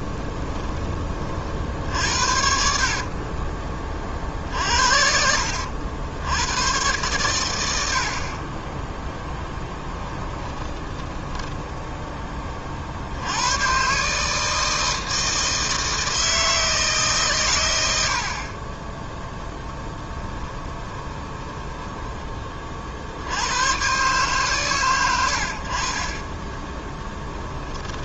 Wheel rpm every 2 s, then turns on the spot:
20, 50, 60, 110, 20, 10, 40, 160, 160, 30, 20, 40, 120, 10.
2-4 10-12 20-22